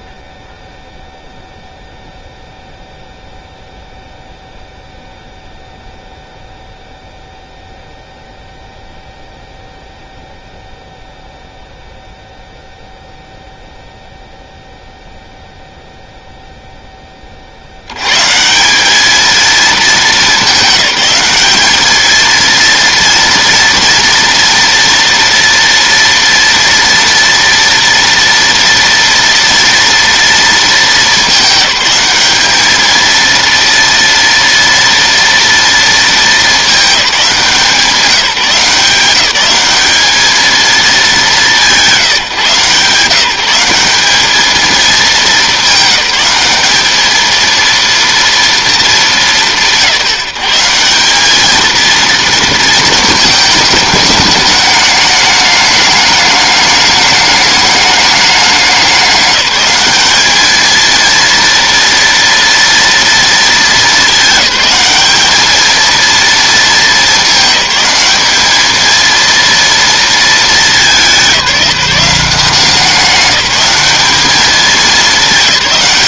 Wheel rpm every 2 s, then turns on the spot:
0, 0, 0, 0, 0, 0, 0, 0, 10, 200, 200, 230, 230, 230, 230, 220, 220, 230, 220, 180, 220, 160, 220, 210, 220, 180, 230, 210, 210, 190, 220, 230, 210, 220, 210, 200, 180, 210.
none